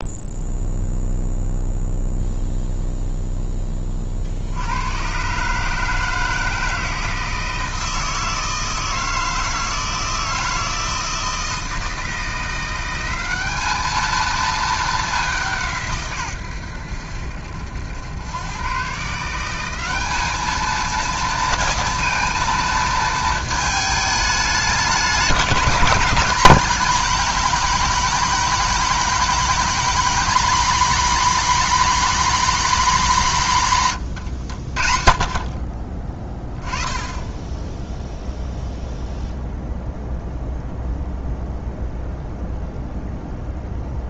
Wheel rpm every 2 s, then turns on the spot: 0, 0, 80, 160, 160, 160, 180, 220, 110, 120, 220, 230, 210, 210, 230, 250, 260, 80, 10, 0, 0, 0.
34-36